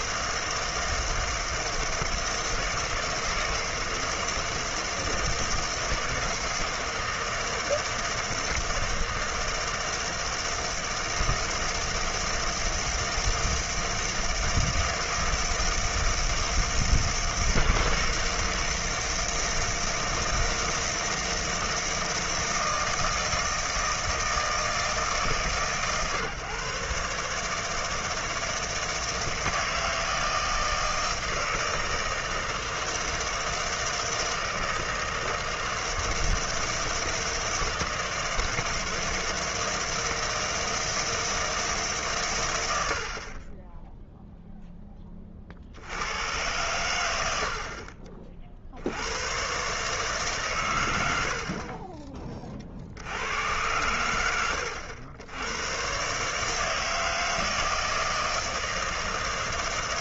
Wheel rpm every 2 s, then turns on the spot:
160, 160, 160, 160, 160, 160, 160, 160, 160, 160, 160, 160, 160, 130, 160, 160, 160, 160, 160, 160, 160, 90, 0, 100, 60, 120, 50, 90, 160, 160.
none